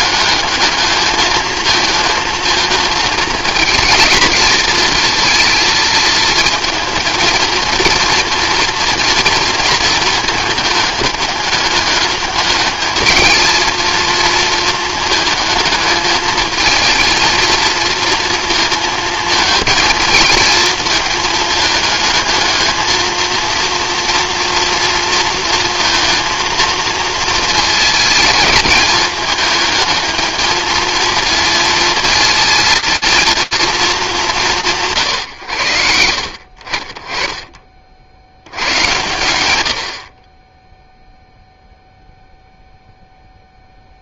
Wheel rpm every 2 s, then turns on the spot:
220, 220, 230, 220, 230, 220, 220, 220, 220, 230, 220, 220, 230, 230, 220, 220, 230, 150, 30, 100, 10, 0.
none